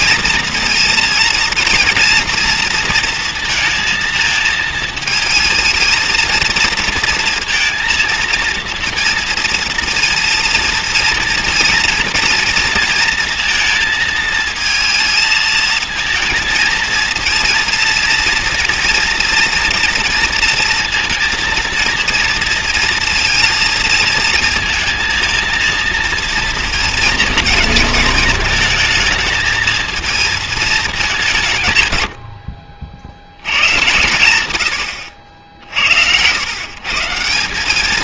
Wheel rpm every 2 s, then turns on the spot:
230, 230, 220, 230, 230, 230, 230, 230, 220, 230, 230, 230, 220, 230, 220, 230, 80, 100, 120.
none